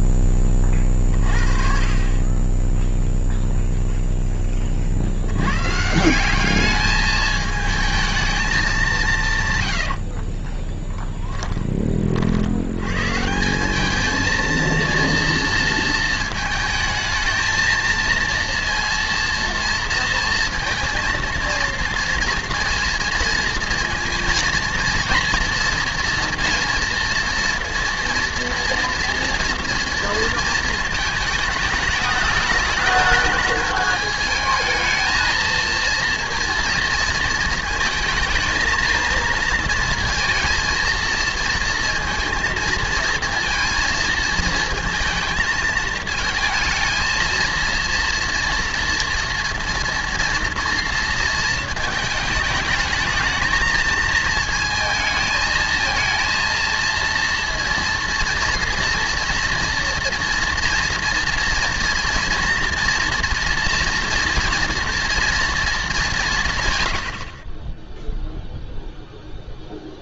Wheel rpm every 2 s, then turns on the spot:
30, 20, 30, 210, 200, 20, 90, 230, 220, 230, 230, 230, 230, 230, 230, 230, 220, 220, 230, 220, 230, 230, 230, 230, 230, 230, 220, 220, 230, 230, 240, 230, 230, 120, 0.
10-12